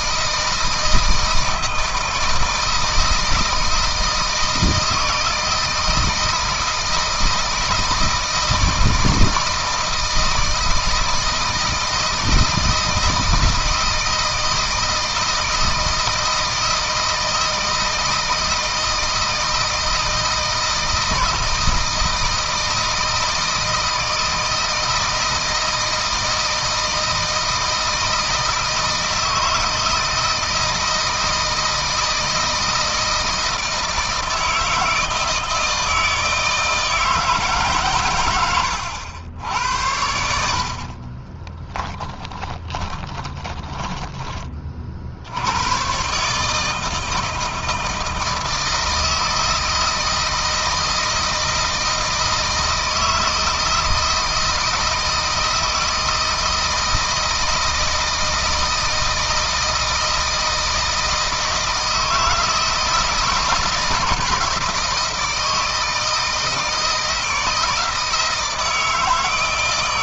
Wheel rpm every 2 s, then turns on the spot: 160, 160, 160, 160, 160, 160, 160, 160, 160, 160, 160, 160, 160, 160, 160, 160, 160, 160, 160, 90, 50, 10, 50, 160, 160, 160, 160, 160, 160, 160, 160, 160, 160, 160, 160.
40-44